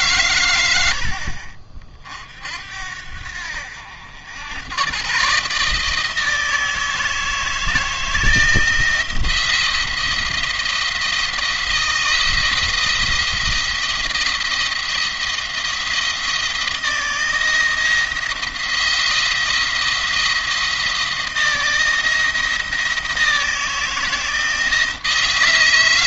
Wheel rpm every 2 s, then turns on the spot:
90, 70, 110, 160, 170, 170, 170, 170, 170, 170, 170, 160, 160.
none